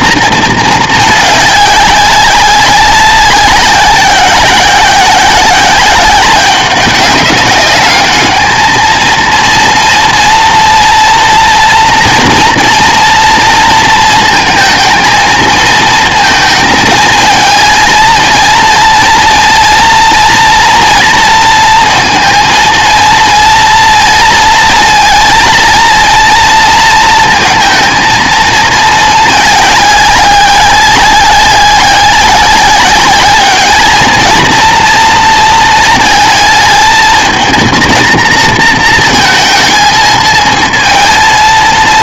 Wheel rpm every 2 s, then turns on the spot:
220, 190, 190, 190, 220, 240, 240, 220, 220, 220, 230, 230, 230, 230, 230, 190, 190, 230, 220, 230, 220.
none